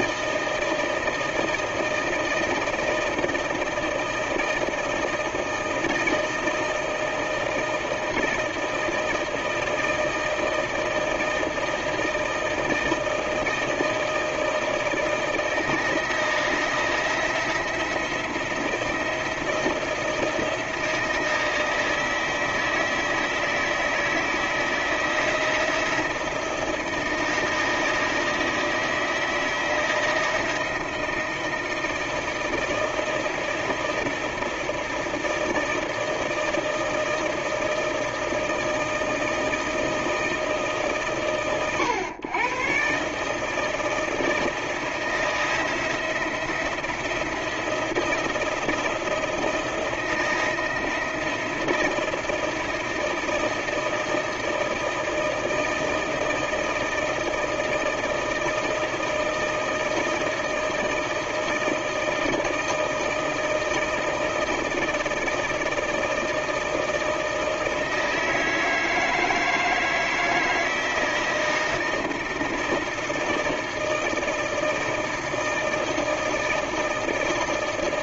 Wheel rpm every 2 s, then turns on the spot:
160, 160, 160, 160, 160, 160, 160, 160, 160, 170, 160, 160, 160, 160, 160, 160, 160, 160, 160, 160, 130, 130, 160, 170, 170, 160, 160, 160, 160, 160, 160, 160, 160, 160, 160, 160, 160, 160, 160.
none